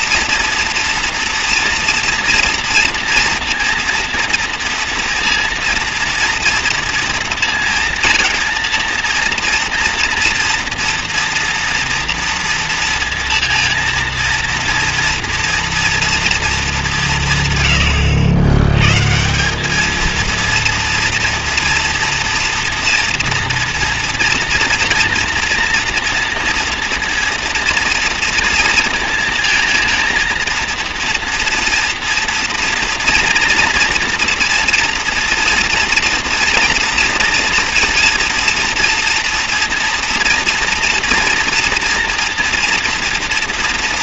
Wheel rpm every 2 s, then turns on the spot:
230, 230, 230, 230, 230, 240, 230, 230, 210, 110, 230, 230, 230, 230, 230, 230, 230, 230, 230, 240, 230, 240.
none